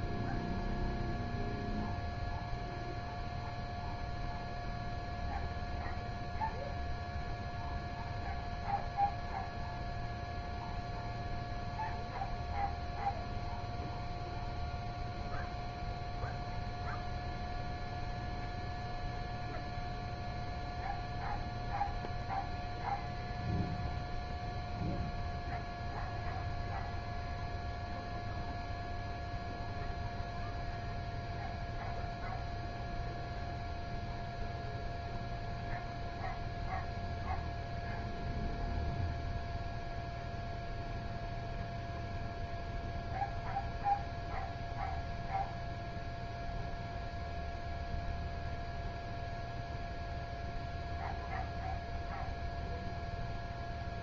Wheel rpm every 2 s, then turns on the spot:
0, 0, 0, 0, 0, 0, 0, 0, 0, 0, 0, 0, 0, 0, 0, 0, 0, 0, 0, 0, 0, 0, 0, 0, 0, 0, 0.
none